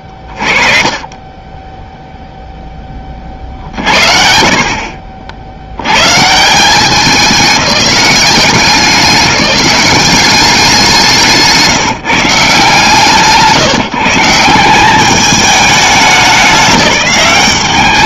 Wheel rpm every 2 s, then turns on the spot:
0, 40, 160, 190, 200, 170, 160, 180, 210.
none